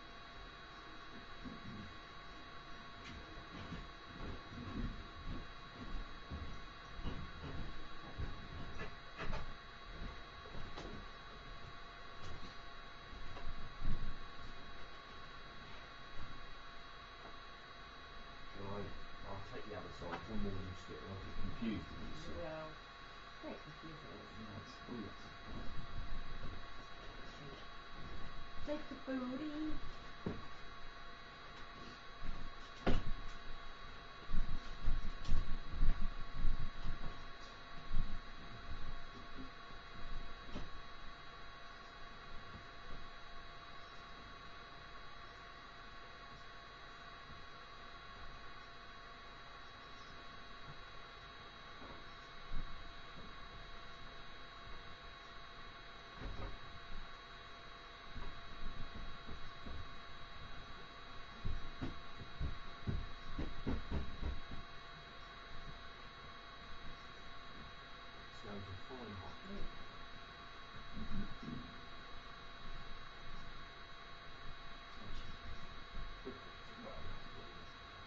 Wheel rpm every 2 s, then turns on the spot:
0, 0, 0, 0, 0, 0, 0, 0, 0, 0, 0, 0, 0, 0, 0, 0, 0, 0, 0, 0, 0, 0, 0, 0, 0, 0, 0, 0, 0, 0, 0, 0, 0, 0, 0, 0, 0, 0, 0.
none